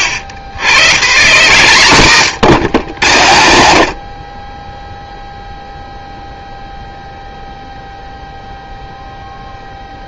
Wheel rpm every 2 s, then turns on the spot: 110, 110, 20, 0, 0.
none